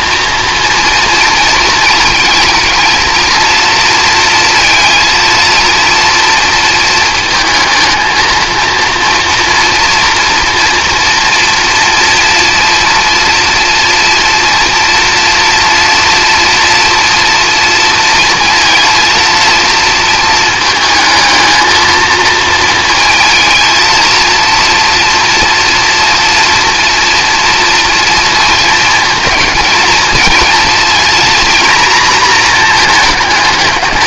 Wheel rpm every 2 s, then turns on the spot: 230, 220, 230, 230, 230, 230, 240, 230, 230, 230, 220, 230, 230, 230, 230, 230, 220.
none